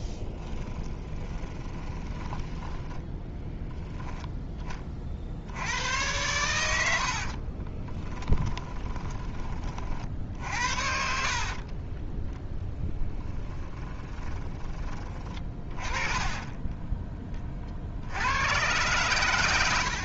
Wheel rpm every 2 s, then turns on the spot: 10, 10, 30, 70, 20, 60, 10, 30, 10, 120.
0-2 6-10 12-14